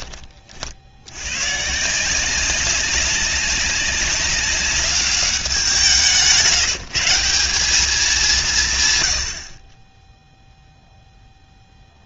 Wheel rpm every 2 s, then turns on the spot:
60, 190, 200, 160, 140, 0.
none